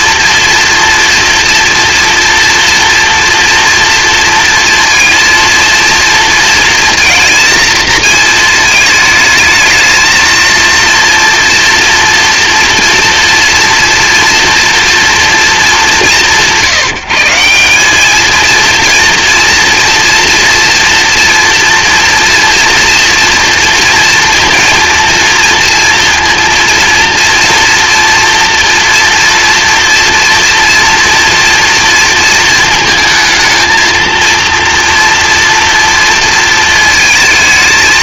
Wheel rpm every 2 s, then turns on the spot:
230, 240, 230, 230, 220, 230, 240, 230, 160, 230, 240, 230, 230, 230, 230, 230, 220, 230, 220.
none